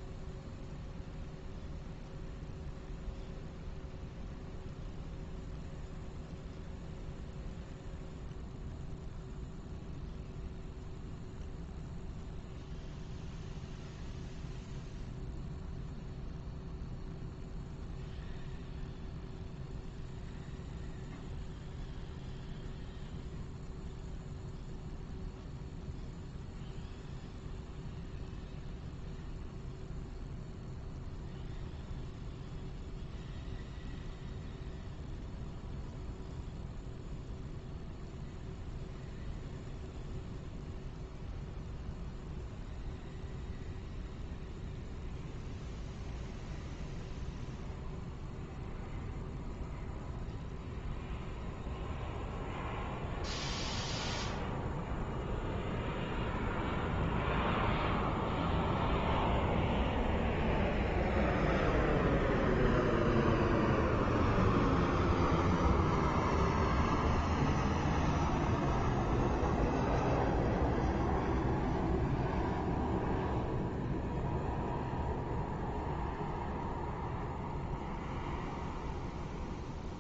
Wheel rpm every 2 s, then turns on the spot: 0, 0, 0, 0, 0, 0, 0, 0, 0, 0, 0, 0, 0, 0, 0, 0, 0, 0, 0, 0, 0, 0, 0, 0, 0, 0, 0, 0, 0, 0, 0, 0, 0, 0, 0, 0, 0, 0, 0, 0.
none